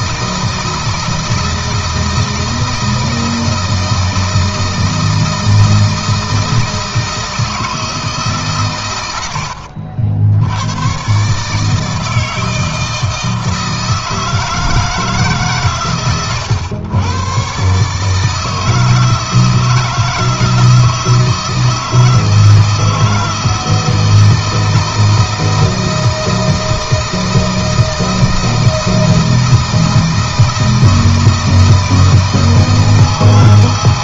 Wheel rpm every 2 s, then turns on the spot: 160, 160, 160, 160, 130, 100, 160, 160, 120, 160, 160, 160, 170, 160, 160, 160, 160.
none